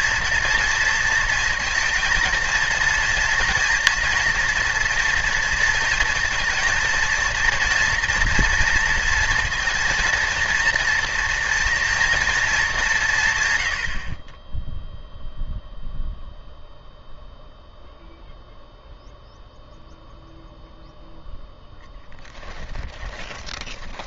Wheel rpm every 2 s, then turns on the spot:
230, 230, 230, 230, 230, 230, 200, 0, 0, 0, 0, 10.
22-24